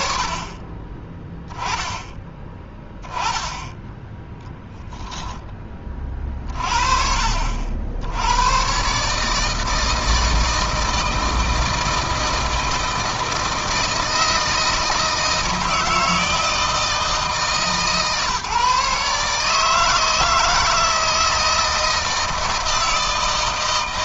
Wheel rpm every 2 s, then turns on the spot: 30, 10, 0, 40, 130, 160, 160, 160, 160, 150, 160, 160.
none